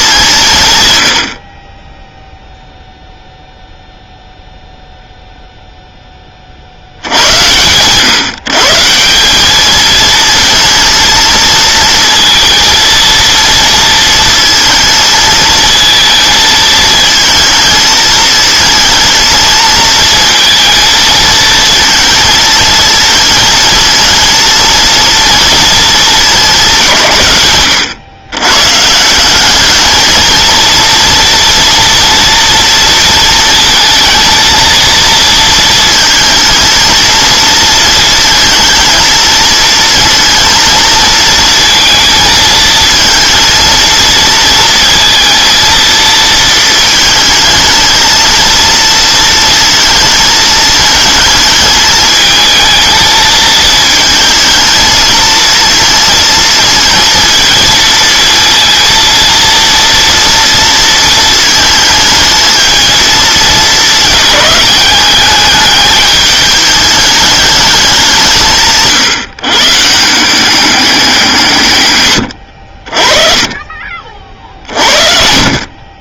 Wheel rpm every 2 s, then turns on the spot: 160, 0, 0, 50, 140, 220, 230, 220, 220, 220, 230, 230, 220, 200, 130, 230, 230, 230, 230, 230, 230, 230, 230, 220, 230, 220, 220, 220, 230, 230, 230, 220, 210, 210, 160, 190, 60, 50.
none